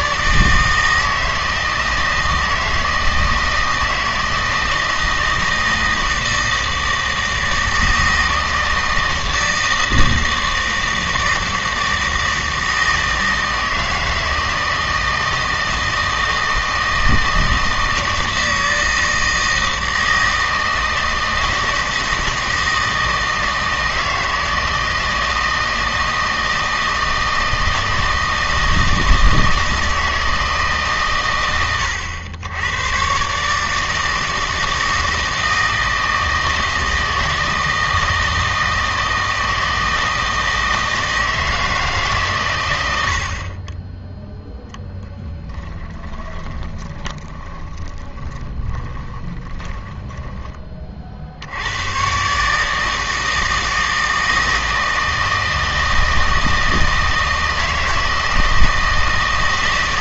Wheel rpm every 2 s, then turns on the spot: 160, 160, 160, 160, 160, 160, 160, 160, 160, 160, 160, 160, 160, 160, 160, 150, 110, 160, 160, 160, 160, 110, 10, 20, 20, 20, 150, 160, 160, 160.
46-50